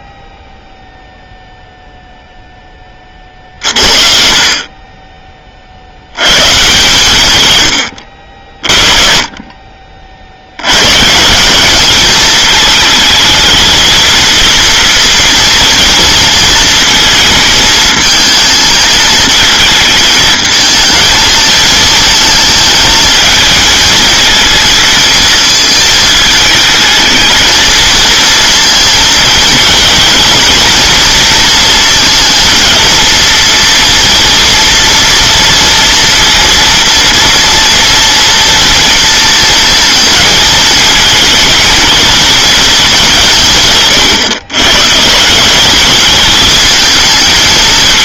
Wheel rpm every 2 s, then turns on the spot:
10, 10, 40, 140, 50, 100, 220, 230, 230, 220, 220, 220, 220, 220, 230, 230, 230, 230, 230, 230, 220, 220, 140, 220.
none